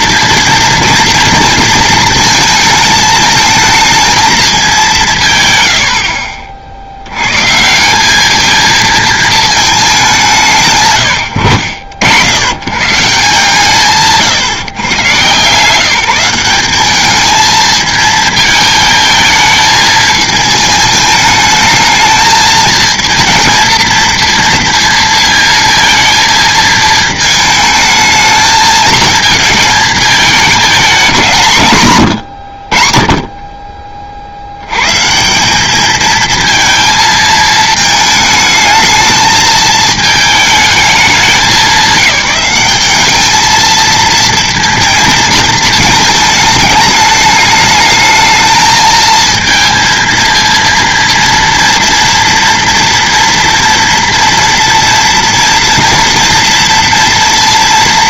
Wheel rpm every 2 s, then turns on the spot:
230, 220, 220, 50, 220, 170, 110, 150, 190, 220, 220, 220, 230, 220, 220, 220, 90, 80, 230, 220, 220, 200, 230, 220, 220, 230, 230, 230, 230.
none